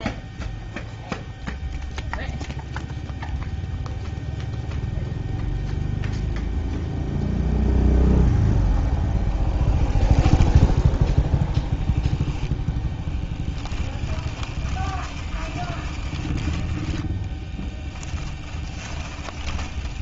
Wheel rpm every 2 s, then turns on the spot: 0, 0, 0, 0, 0, 0, 0, 20, 10, 10.
14-16 18-20